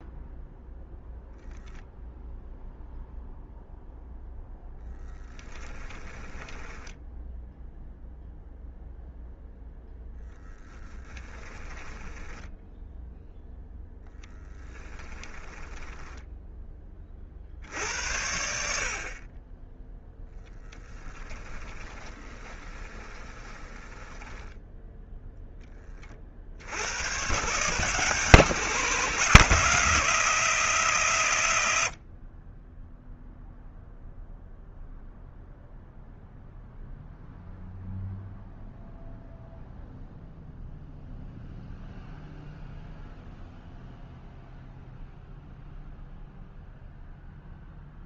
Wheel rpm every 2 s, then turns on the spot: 0, 0, 10, 10, 0, 10, 0, 10, 30, 50, 20, 20, 0, 110, 160, 130, 0, 0, 0, 0, 0, 0, 0, 0.
4-8 10-12 14-16 20-24